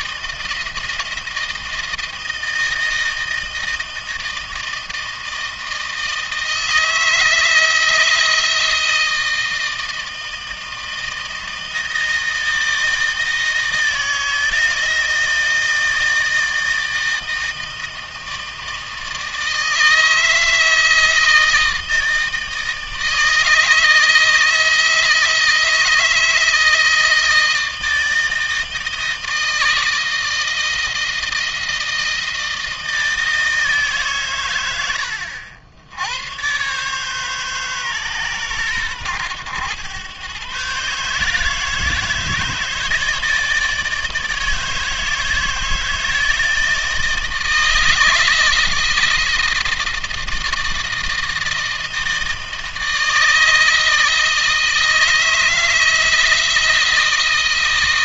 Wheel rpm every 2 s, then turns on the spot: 170, 160, 160, 160, 160, 160, 160, 160, 160, 160, 160, 160, 160, 160, 160, 160, 160, 110, 120, 120, 130, 150, 150, 160, 160, 160, 160, 160, 160.
none